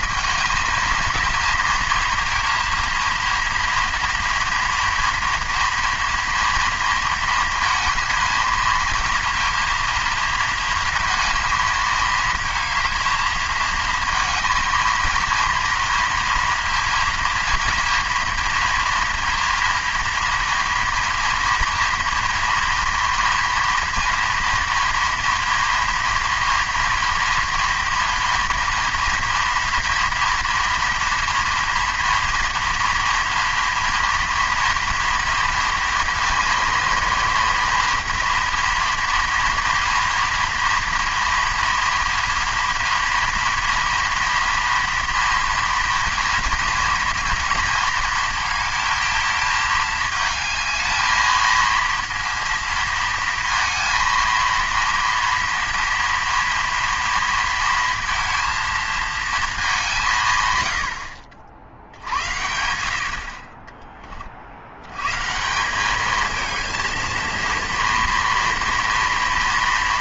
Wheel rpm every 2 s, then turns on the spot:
220, 230, 230, 230, 230, 230, 220, 230, 230, 230, 230, 230, 230, 230, 230, 240, 230, 230, 230, 230, 230, 230, 240, 240, 220, 220, 230, 230, 230, 230, 80, 80, 90, 220, 230.
none